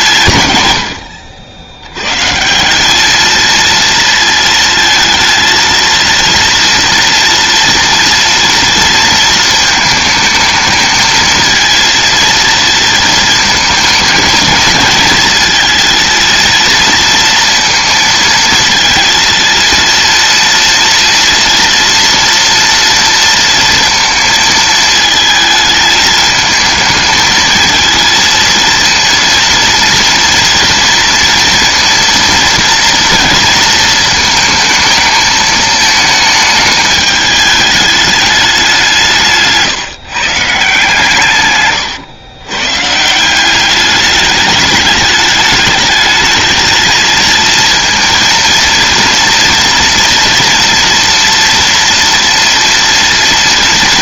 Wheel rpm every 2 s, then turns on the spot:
120, 170, 230, 230, 230, 220, 230, 230, 230, 230, 230, 230, 220, 220, 230, 230, 230, 220, 220, 200, 160, 130, 210, 220, 230, 230, 230.
none